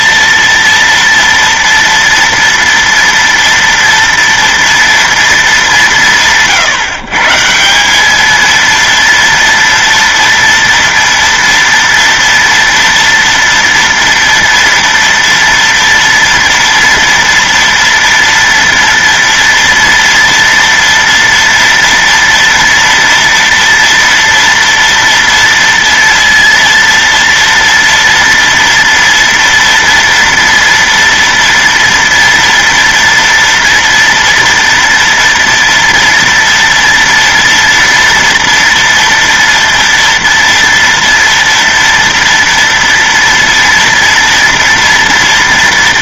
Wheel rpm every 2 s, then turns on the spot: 230, 230, 230, 120, 230, 230, 230, 230, 230, 230, 230, 230, 230, 230, 230, 230, 230, 230, 230, 230, 230, 230, 230.
none